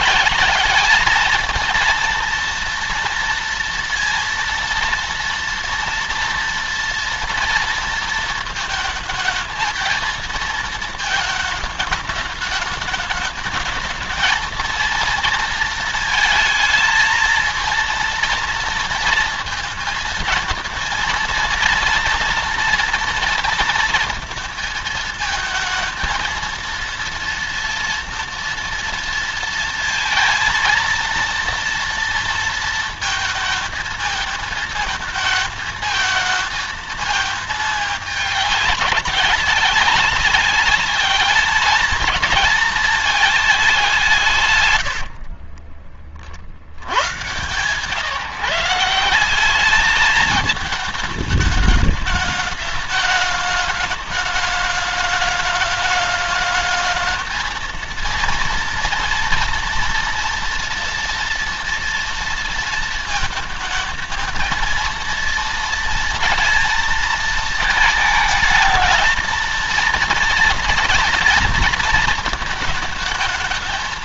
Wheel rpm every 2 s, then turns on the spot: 210, 230, 230, 230, 220, 220, 210, 230, 230, 240, 230, 230, 220, 230, 230, 230, 230, 220, 220, 200, 210, 220, 130, 60, 160, 220, 210, 210, 210, 230, 230, 230, 230, 230, 230, 230, 220.
44-46